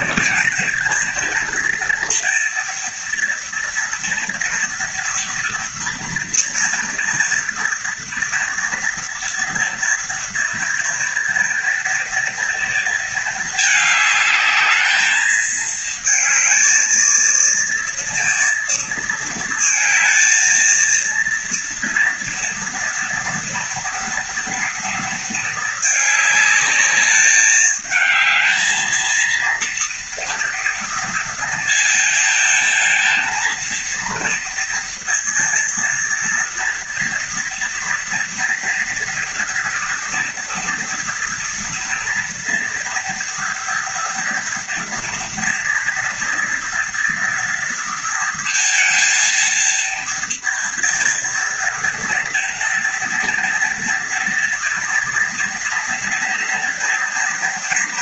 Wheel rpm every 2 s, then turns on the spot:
230, 230, 230, 230, 240, 230, 220, 210, 220, 230, 230, 230, 230, 210, 230, 230, 230, 230, 230, 230, 230, 230, 230, 230, 230, 230, 230, 230, 230.
none